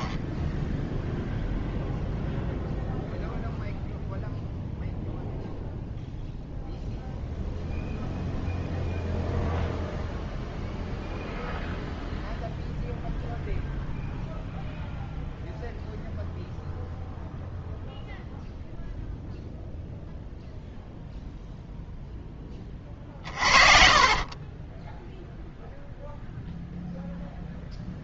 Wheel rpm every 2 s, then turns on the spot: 10, 0, 0, 0, 0, 0, 0, 0, 0, 0, 0, 20, 20, 0.
24-26